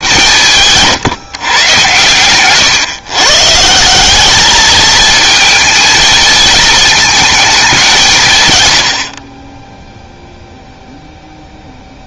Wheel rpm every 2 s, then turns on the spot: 210, 130, 180, 220, 190, 20.
none